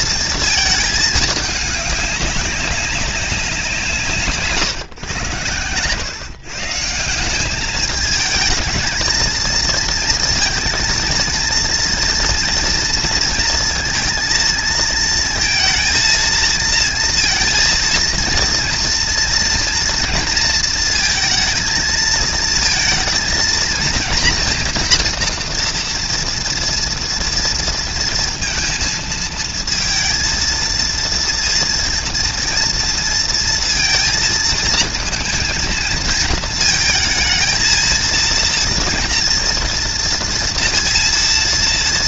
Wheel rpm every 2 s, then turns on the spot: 210, 200, 130, 170, 230, 230, 230, 230, 230, 230, 230, 230, 240, 230, 230, 230, 230, 230, 230, 230, 230.
none